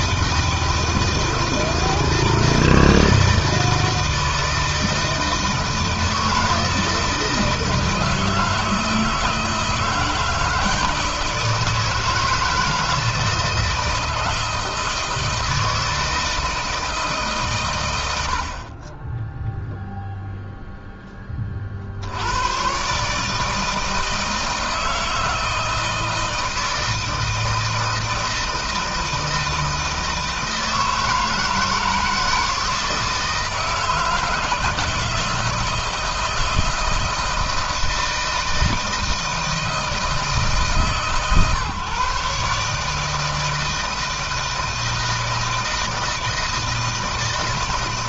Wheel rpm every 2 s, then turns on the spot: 160, 160, 160, 160, 160, 160, 160, 160, 160, 60, 0, 110, 160, 160, 160, 160, 160, 160, 160, 160, 150, 150, 160, 160.
none